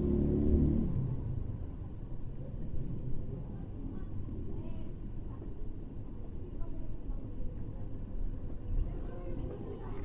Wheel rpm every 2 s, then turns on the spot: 0, 0, 0, 0, 0.
none